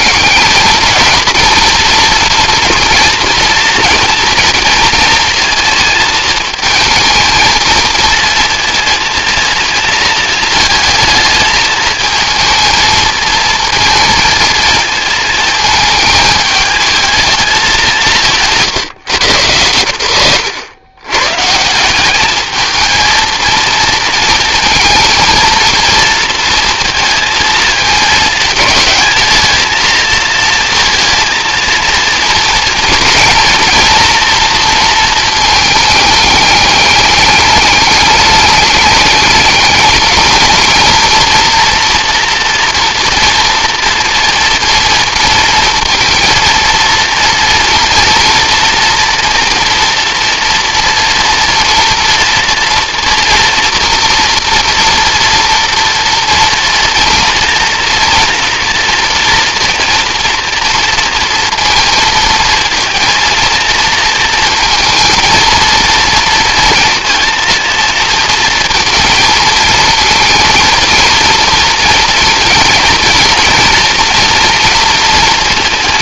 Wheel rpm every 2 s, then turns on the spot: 220, 240, 230, 220, 230, 220, 230, 230, 220, 140, 110, 220, 220, 230, 220, 230, 230, 230, 210, 210, 220, 230, 230, 230, 230, 240, 230, 240, 230, 230, 230, 230, 230, 230, 230, 230, 230, 230.
none